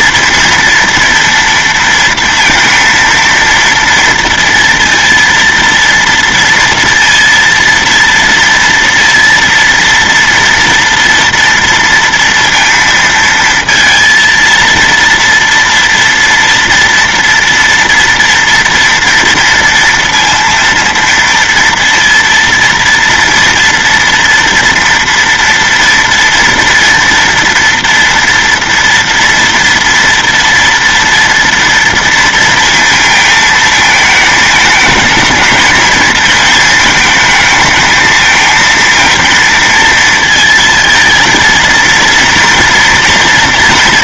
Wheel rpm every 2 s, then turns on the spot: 230, 230, 230, 230, 230, 230, 230, 230, 240, 230, 230, 230, 230, 230, 230, 230, 230, 220, 220, 230, 230, 230.
none